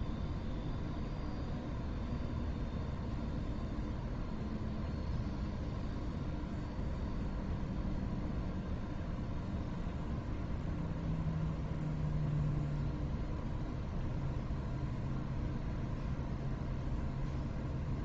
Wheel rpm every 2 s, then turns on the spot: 0, 0, 0, 0, 0, 0, 0, 0, 0.
none